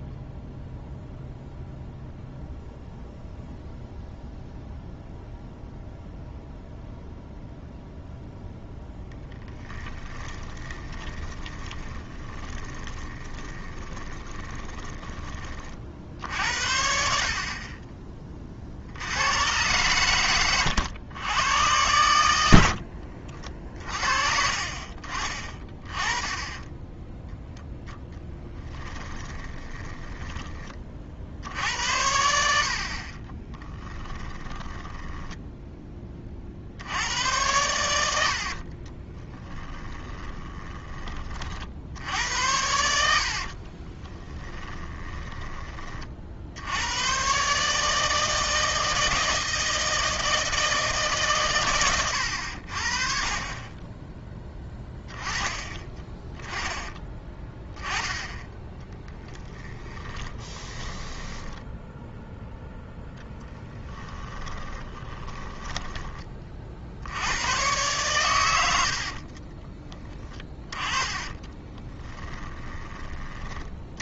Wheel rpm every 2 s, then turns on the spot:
0, 0, 0, 0, 0, 20, 30, 20, 60, 70, 100, 60, 40, 10, 20, 50, 50, 10, 70, 40, 20, 80, 10, 100, 160, 150, 60, 10, 20, 10, 20, 0, 30, 60, 70, 30, 30.
10-16 22-24 28-30 34-36 38-40 44-46 56-62 64-66 68-72